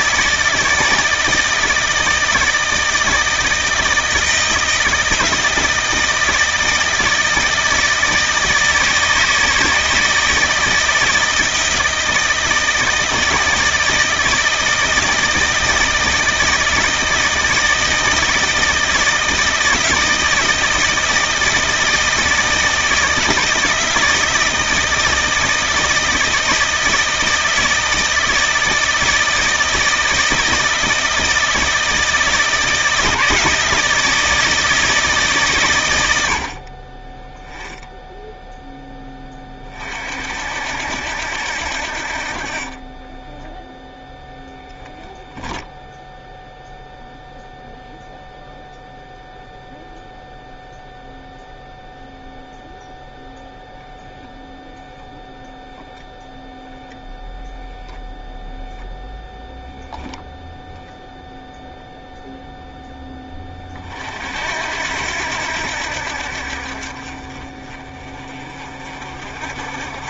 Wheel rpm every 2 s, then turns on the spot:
160, 160, 160, 160, 160, 160, 160, 160, 160, 160, 160, 160, 160, 160, 160, 160, 160, 160, 40, 10, 70, 30, 0, 0, 0, 0, 0, 0, 0, 0, 0, 10, 80, 50, 40.
42-44